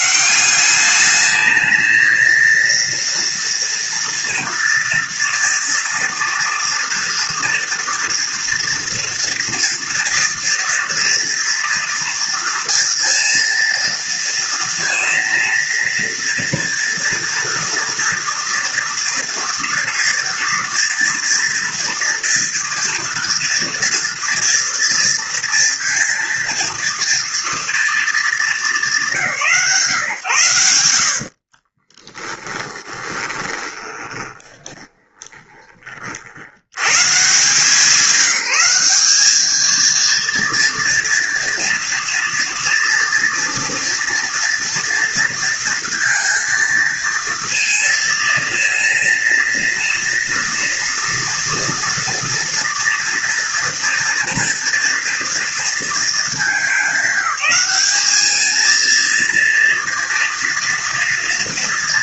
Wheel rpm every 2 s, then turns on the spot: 200, 230, 230, 230, 230, 230, 230, 230, 230, 230, 230, 240, 230, 230, 170, 80, 20, 20, 110, 200, 230, 230, 230, 230, 230, 230, 240, 230, 200, 220, 230.
32-36